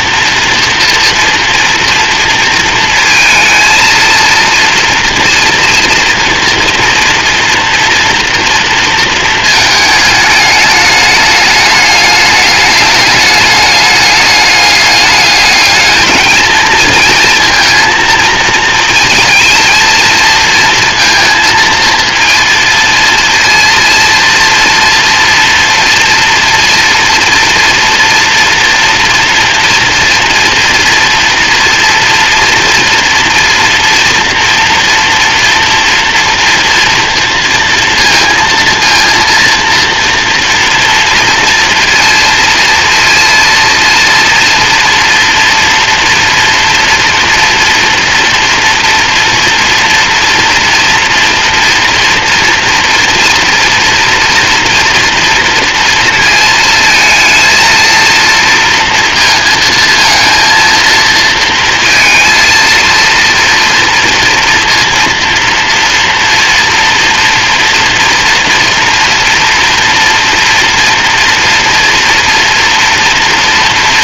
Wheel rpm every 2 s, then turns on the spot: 230, 220, 230, 240, 230, 210, 210, 210, 230, 230, 230, 230, 230, 240, 230, 240, 230, 230, 230, 230, 230, 230, 240, 230, 230, 230, 230, 230, 220, 230, 230, 230, 230, 230, 230, 240, 230.
none